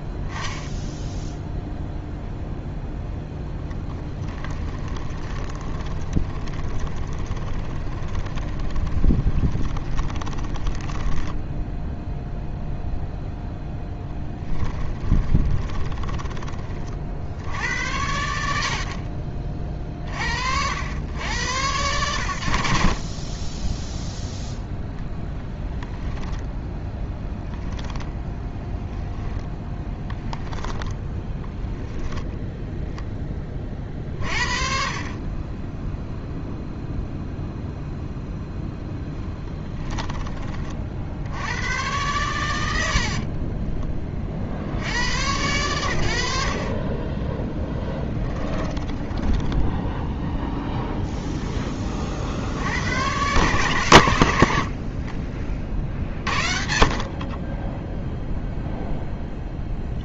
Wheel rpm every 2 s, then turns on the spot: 0, 0, 20, 20, 20, 20, 0, 10, 20, 80, 70, 60, 0, 10, 10, 0, 0, 40, 0, 0, 30, 100, 60, 50, 10, 0, 60, 70, 50, 0.
4-12 26-28 48-50 54-56